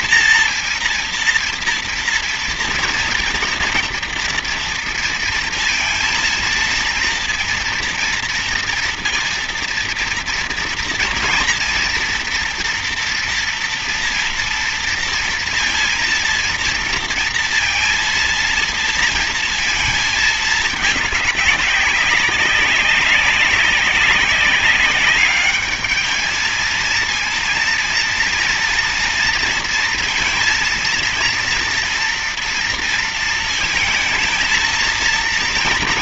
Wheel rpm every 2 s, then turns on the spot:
230, 230, 240, 230, 230, 230, 230, 230, 230, 230, 210, 190, 200, 220, 230, 230, 230, 220.
none